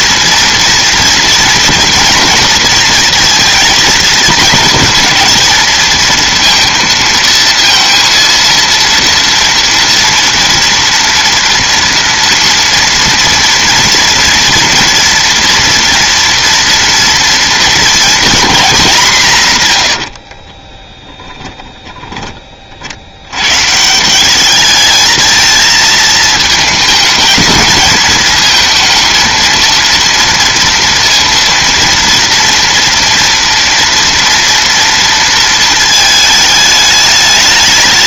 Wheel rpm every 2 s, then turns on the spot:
230, 230, 230, 230, 230, 230, 230, 230, 230, 210, 20, 50, 210, 220, 220, 230, 230, 230, 210.
20-22